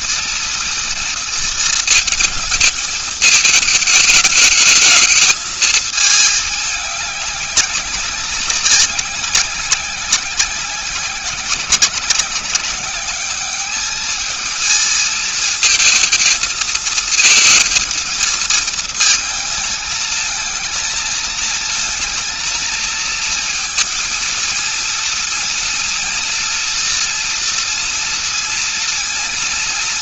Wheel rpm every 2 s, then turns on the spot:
230, 220, 220, 210, 190, 190, 190, 220, 220, 230, 220, 230, 230, 230, 230.
none